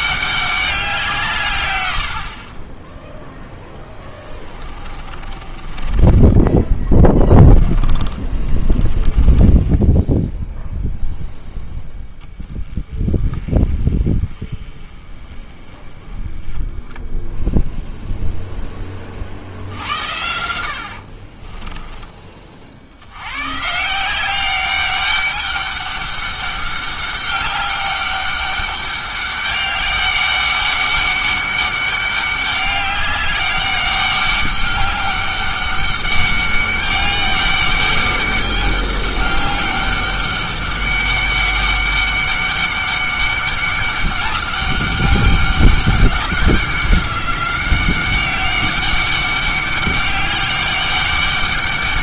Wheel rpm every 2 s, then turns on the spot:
190, 20, 20, 20, 20, 0, 20, 20, 10, 10, 70, 50, 200, 200, 200, 200, 200, 200, 200, 200, 200, 200, 200, 190, 190, 200.
4-6 8-10 20-22